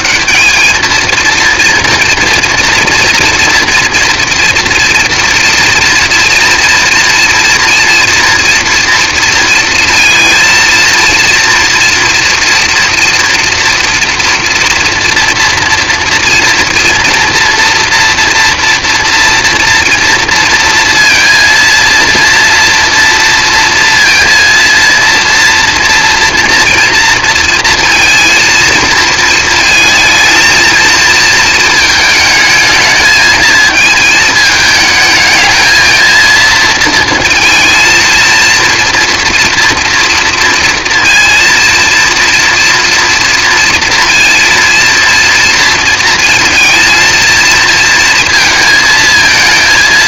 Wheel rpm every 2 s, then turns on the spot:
220, 240, 240, 230, 230, 230, 230, 230, 230, 230, 230, 230, 230, 230, 220, 220, 220, 220, 230, 230, 230, 230, 240, 220, 220.
none